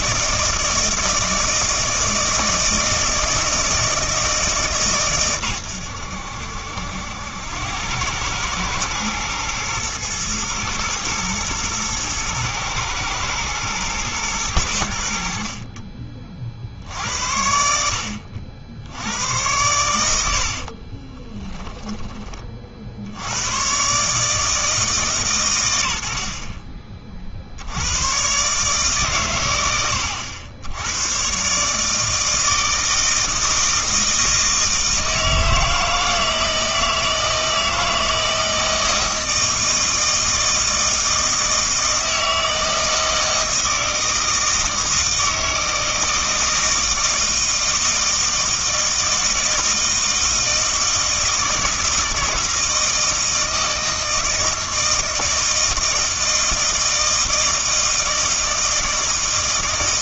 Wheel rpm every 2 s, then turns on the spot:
160, 160, 150, 80, 110, 110, 110, 90, 60, 70, 60, 40, 150, 40, 140, 90, 160, 160, 160, 160, 160, 160, 160, 160, 160, 160, 160, 160, 160, 160.
20-22